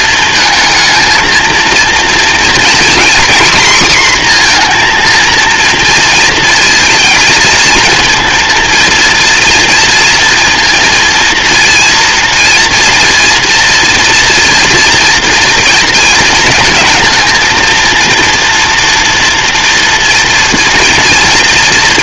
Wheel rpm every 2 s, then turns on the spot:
230, 240, 240, 230, 230, 230, 230, 230, 230, 230, 230.
none